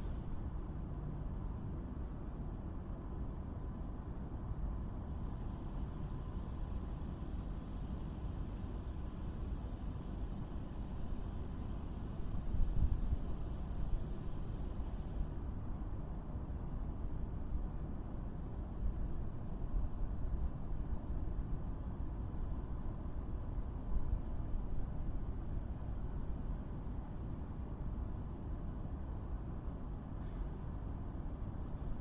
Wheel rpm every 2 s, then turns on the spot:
0, 0, 0, 0, 0, 0, 0, 0, 0, 0, 0, 0, 0, 0, 0, 0.
none